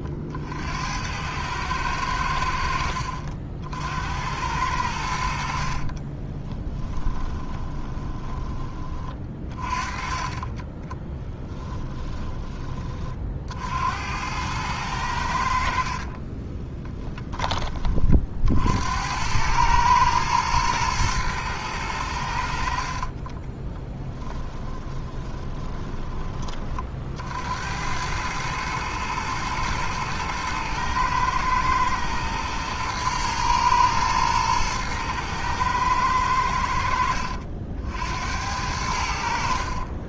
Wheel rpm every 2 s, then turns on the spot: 70, 70, 90, 20, 40, 20, 30, 100, 30, 60, 110, 60, 20, 40, 110, 110, 110, 110, 70, 80.
6-8 16-18 22-26